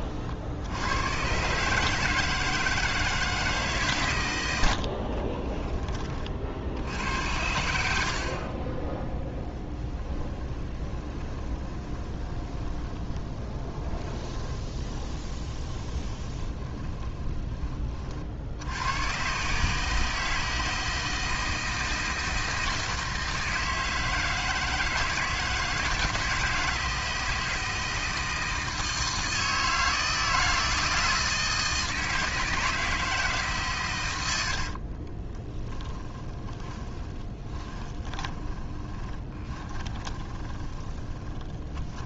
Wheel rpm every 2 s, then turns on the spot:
110, 160, 60, 60, 20, 20, 20, 20, 20, 90, 160, 160, 160, 160, 160, 160, 160, 40, 20, 20, 20.
4-6 10-18 34-42